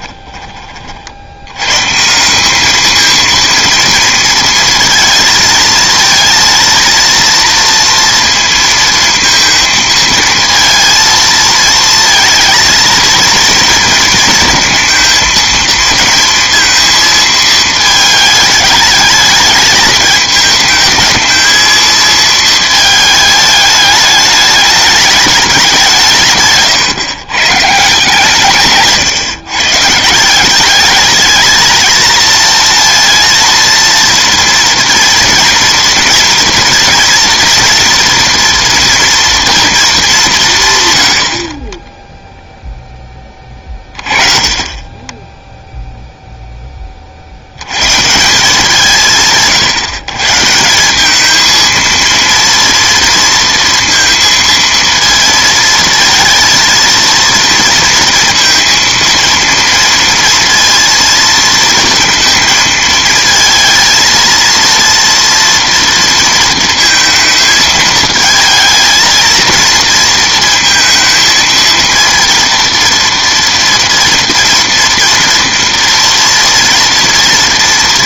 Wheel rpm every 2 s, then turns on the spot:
30, 200, 220, 230, 230, 230, 230, 230, 230, 210, 220, 220, 210, 150, 160, 190, 230, 230, 230, 230, 160, 0, 30, 10, 170, 160, 230, 230, 230, 230, 230, 220, 230, 230, 220, 230, 230, 230, 230.
none